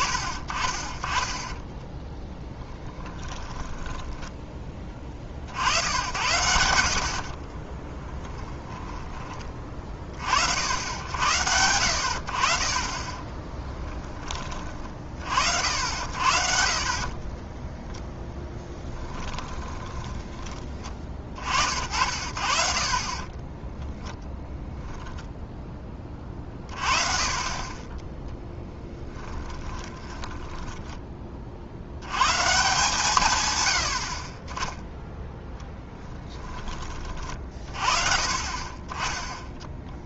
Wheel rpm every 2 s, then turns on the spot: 20, 10, 20, 80, 10, 70, 40, 30, 50, 10, 20, 50, 10, 30, 10, 10, 140, 10, 20, 30.
2-4 8-10 18-20 28-32